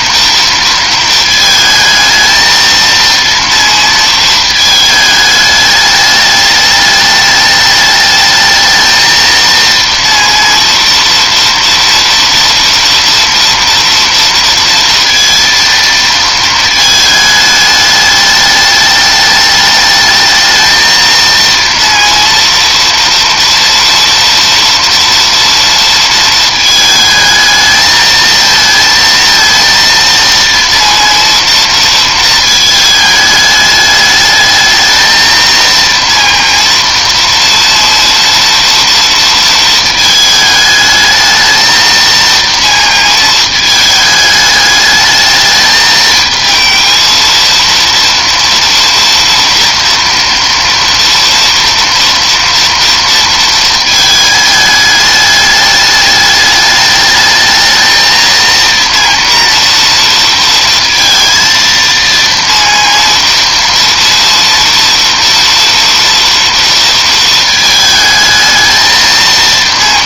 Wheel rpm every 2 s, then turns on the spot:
230, 220, 220, 210, 220, 230, 230, 230, 220, 210, 220, 230, 230, 220, 220, 230, 220, 220, 230, 230, 220, 230, 210, 220, 230, 230, 230, 210, 210, 230, 230, 230, 230, 230, 220.
none